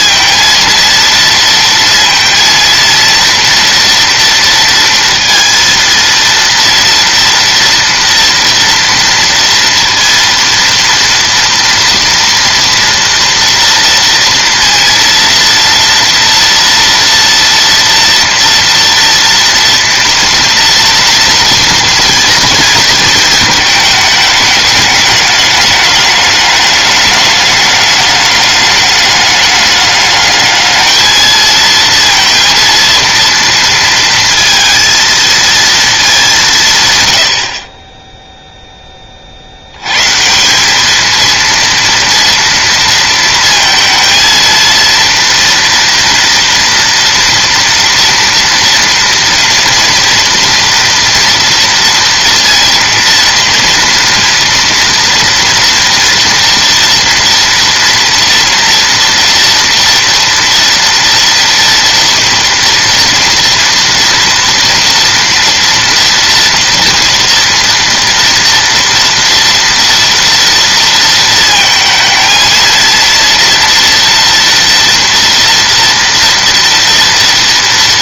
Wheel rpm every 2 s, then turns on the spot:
230, 230, 230, 230, 230, 230, 230, 230, 230, 230, 230, 230, 210, 200, 200, 210, 230, 230, 150, 10, 200, 230, 230, 230, 230, 230, 230, 240, 230, 230, 240, 230, 230, 230, 230, 230, 230, 230, 230.
none